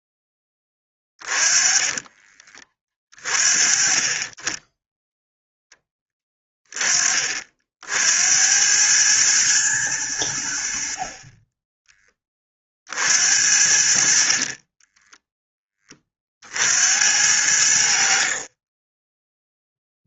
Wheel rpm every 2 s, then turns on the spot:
20, 30, 10, 40, 110, 40, 50, 10, 80, 10.
0-2 14-16